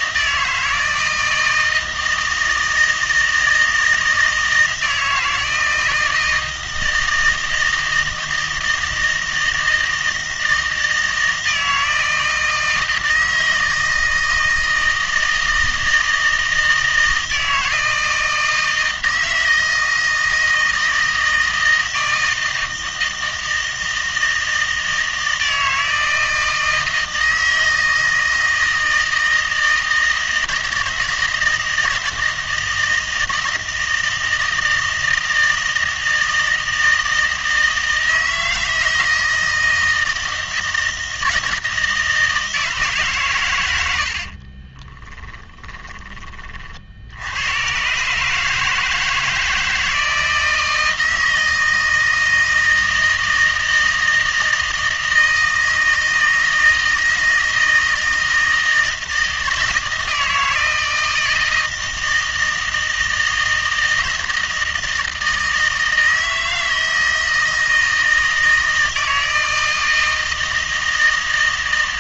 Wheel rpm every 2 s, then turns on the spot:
160, 160, 160, 160, 160, 160, 160, 160, 160, 160, 160, 160, 160, 160, 160, 160, 160, 160, 160, 160, 160, 160, 30, 40, 160, 160, 160, 160, 160, 160, 160, 160, 160, 160, 160, 160.
44-46